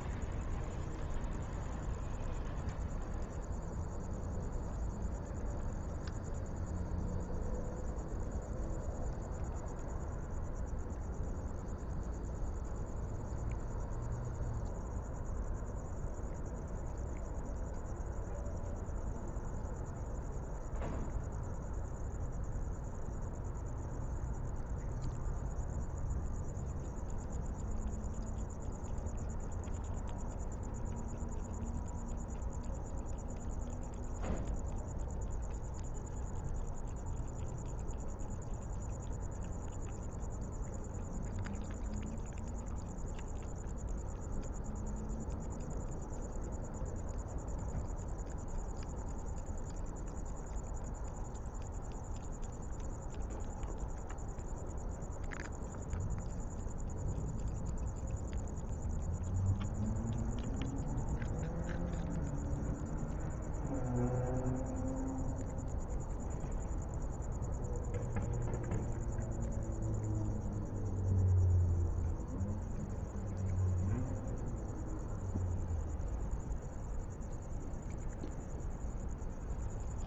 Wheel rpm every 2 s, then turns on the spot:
0, 0, 0, 0, 0, 0, 0, 0, 0, 0, 0, 0, 0, 0, 0, 0, 0, 0, 0, 0, 0, 0, 0, 0, 0, 0, 0, 0, 0, 0, 0, 0, 0, 0, 0, 0, 0, 0, 0, 0.
none